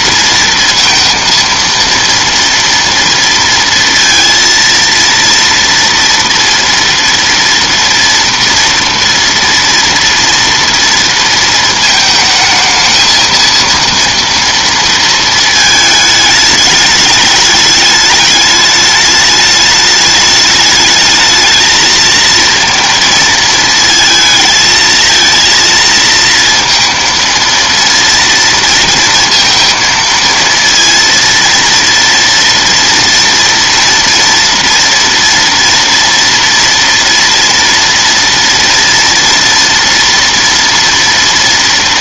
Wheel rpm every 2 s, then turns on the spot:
230, 230, 230, 230, 230, 230, 220, 230, 220, 210, 210, 230, 220, 230, 230, 230, 230, 230, 240, 230, 230.
none